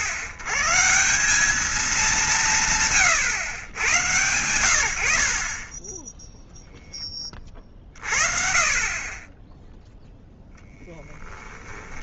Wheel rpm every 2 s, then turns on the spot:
130, 150, 100, 0, 40, 0.
none